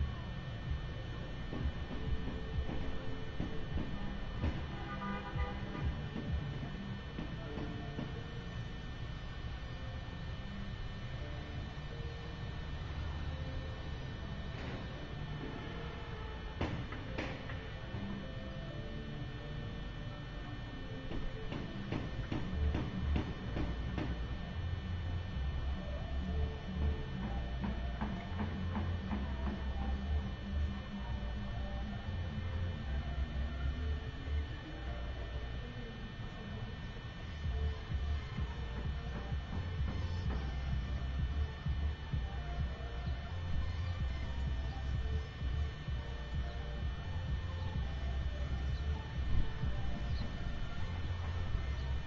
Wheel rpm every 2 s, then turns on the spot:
0, 0, 0, 0, 0, 0, 0, 0, 0, 0, 0, 0, 0, 0, 0, 0, 0, 0, 0, 0, 0, 0, 0, 0, 0, 0.
none